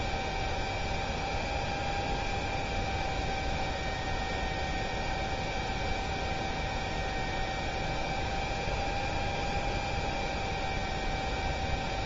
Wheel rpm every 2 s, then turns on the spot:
0, 0, 0, 0, 0, 0.
none